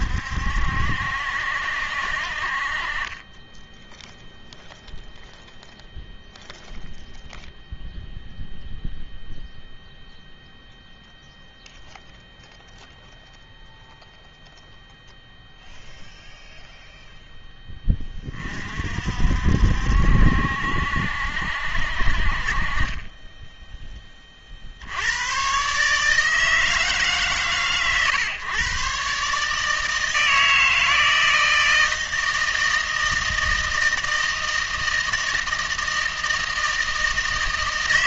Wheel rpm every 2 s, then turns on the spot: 70, 40, 0, 0, 0, 0, 0, 0, 0, 50, 70, 30, 70, 160, 130, 160, 160, 160, 160.
none